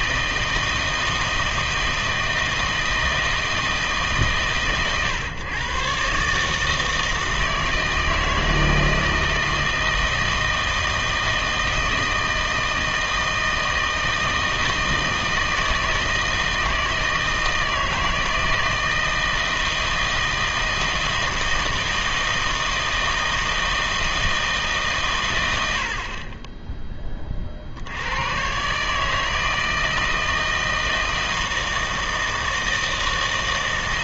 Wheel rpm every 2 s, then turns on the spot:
160, 160, 130, 160, 160, 160, 160, 160, 160, 160, 160, 160, 150, 10, 140, 160, 160.
none